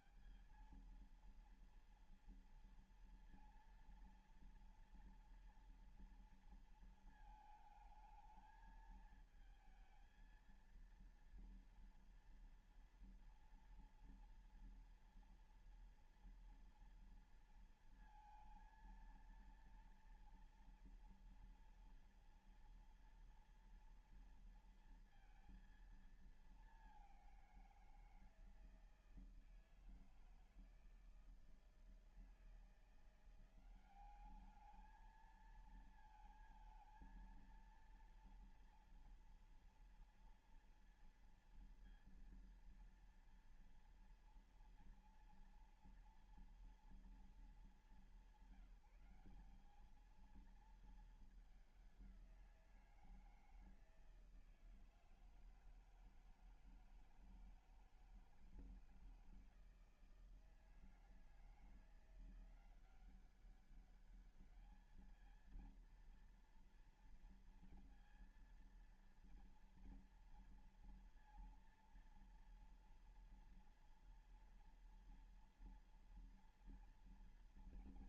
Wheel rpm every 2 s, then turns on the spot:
190, 230, 230, 230, 220, 230, 230, 240, 230, 230, 230, 230, 230, 220, 170, 160, 160, 210, 220, 230, 230, 230, 230, 230, 190, 220, 180, 160, 160, 160, 160, 170, 210, 230, 230, 230, 230, 230, 230.
none